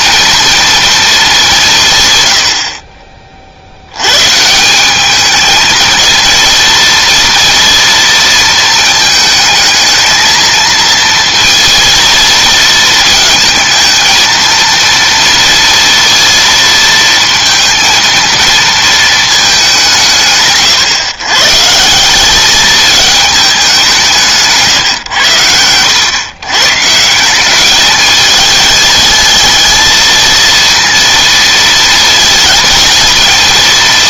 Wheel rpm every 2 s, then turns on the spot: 230, 60, 180, 230, 220, 230, 230, 230, 230, 230, 150, 210, 150, 140, 220, 230, 220.
24-26